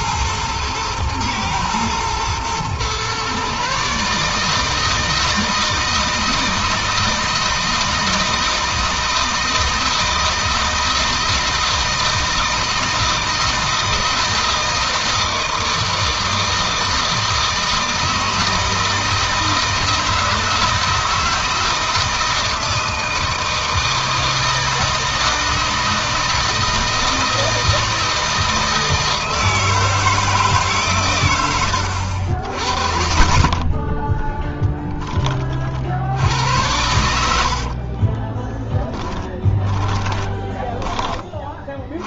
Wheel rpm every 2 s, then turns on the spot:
110, 120, 150, 160, 160, 160, 160, 160, 160, 160, 160, 160, 160, 160, 160, 150, 60, 10, 90, 10, 10.
38-40